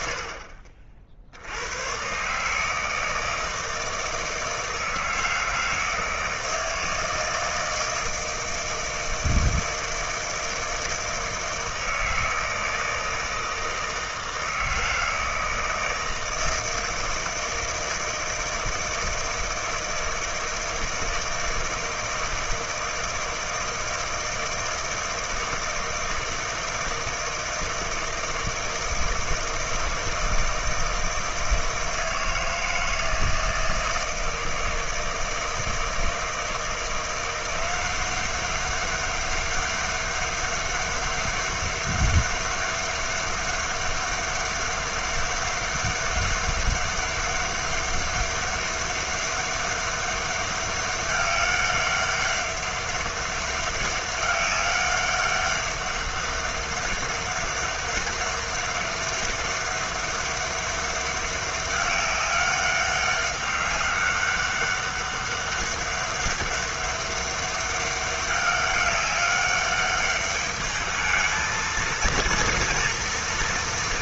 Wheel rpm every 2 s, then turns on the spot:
50, 160, 160, 160, 160, 160, 160, 160, 160, 160, 160, 160, 160, 160, 160, 160, 160, 160, 170, 200, 200, 200, 200, 200, 200, 200, 200, 200, 200, 200, 200, 200, 200, 200, 200, 210, 230.
none